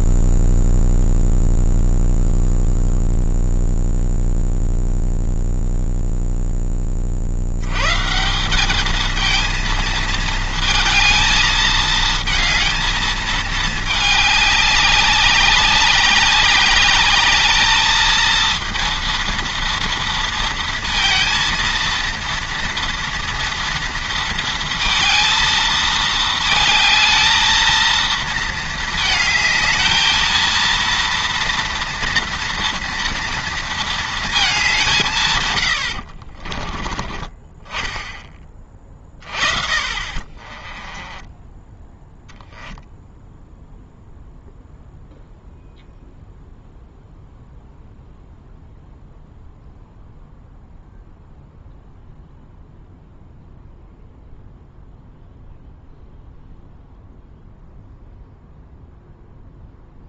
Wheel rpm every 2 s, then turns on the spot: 0, 0, 0, 0, 160, 220, 220, 210, 200, 220, 230, 230, 230, 220, 220, 230, 230, 220, 40, 20, 20, 10, 0, 0, 0, 0, 0, 0, 0, 0.
36-38 40-42